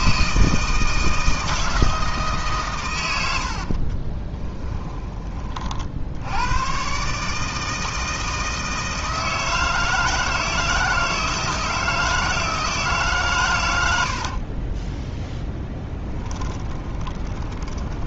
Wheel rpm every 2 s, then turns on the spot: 160, 110, 30, 130, 160, 160, 150, 20, 20.
4-6 14-18